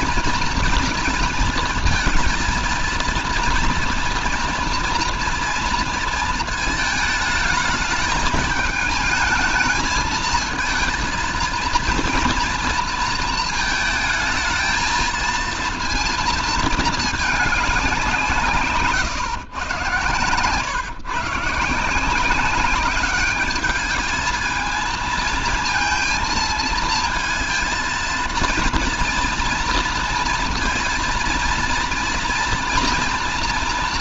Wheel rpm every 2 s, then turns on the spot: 230, 230, 230, 220, 220, 230, 230, 220, 220, 130, 130, 200, 220, 230, 230, 230, 230.
18-20